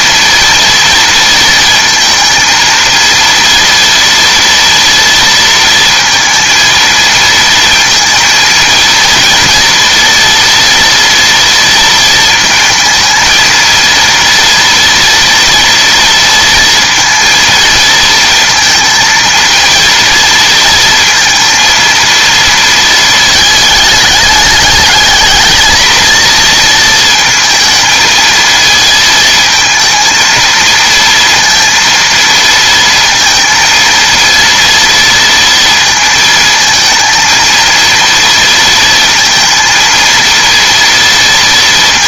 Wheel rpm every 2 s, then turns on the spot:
230, 230, 230, 230, 230, 230, 220, 230, 230, 230, 230, 230, 210, 230, 220, 230, 230, 230, 220, 230, 230.
none